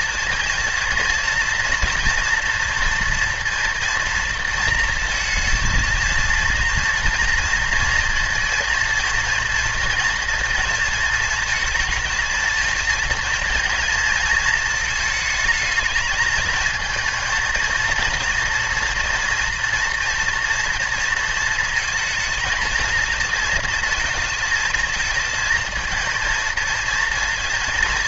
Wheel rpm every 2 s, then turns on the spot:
230, 230, 230, 230, 230, 220, 220, 220, 230, 230, 240, 230, 220, 230.
none